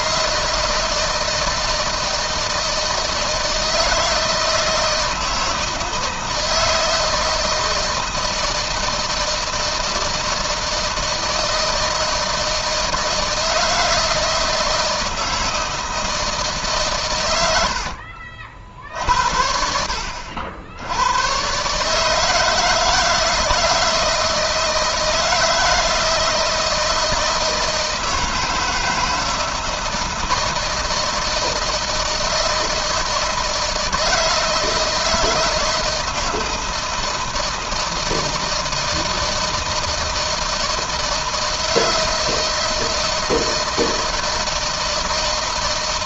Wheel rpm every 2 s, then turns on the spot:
160, 160, 160, 160, 160, 160, 160, 160, 150, 50, 80, 150, 160, 160, 160, 160, 160, 160, 170, 160, 160, 160, 160.
none